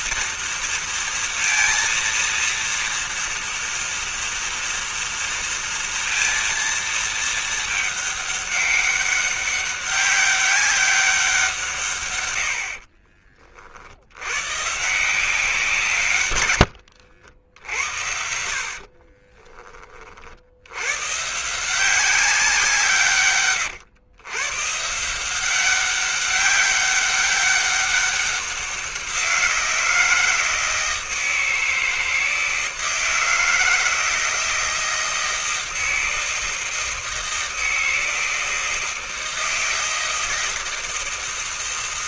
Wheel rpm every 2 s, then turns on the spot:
230, 230, 230, 230, 210, 200, 130, 70, 130, 70, 40, 180, 120, 200, 190, 160, 160, 160, 160, 160, 160.
none